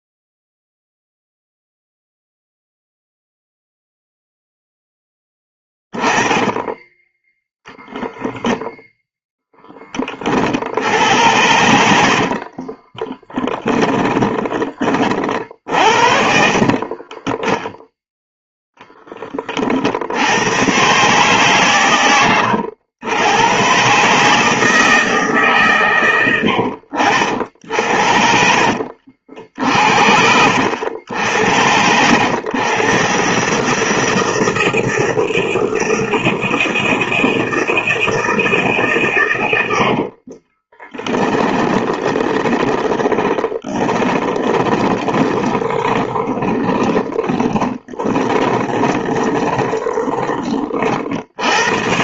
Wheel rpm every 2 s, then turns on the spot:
0, 0, 10, 10, 0, 80, 20, 40, 30, 10, 130, 100, 160, 70, 60, 80, 120, 160, 160, 130, 10, 20, 20, 20, 20, 60.
12-18 26-30 40-50